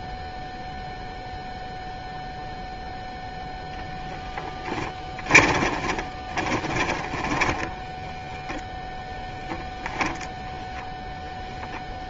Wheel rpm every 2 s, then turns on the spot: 0, 0, 10, 20, 0, 0.
6-8